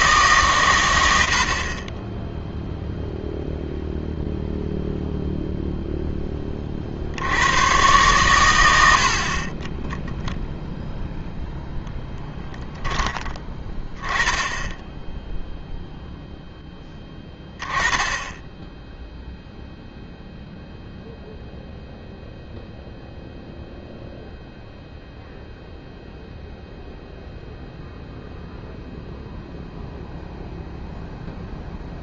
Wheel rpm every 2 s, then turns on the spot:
120, 0, 0, 40, 90, 0, 20, 10, 10, 10, 0, 0, 0, 0, 0, 0.
8-10